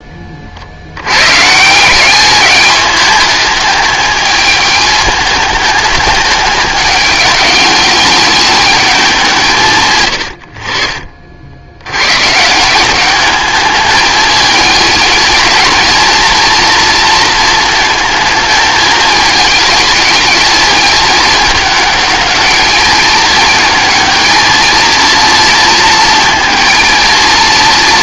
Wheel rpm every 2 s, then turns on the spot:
90, 210, 210, 210, 200, 40, 190, 220, 230, 220, 220, 220, 230, 230.
none